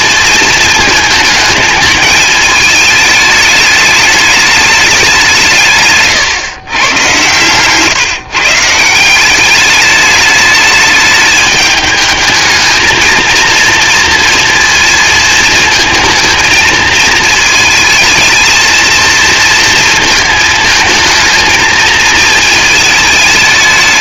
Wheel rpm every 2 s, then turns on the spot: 220, 220, 200, 120, 160, 220, 220, 230, 220, 220, 220, 220.
none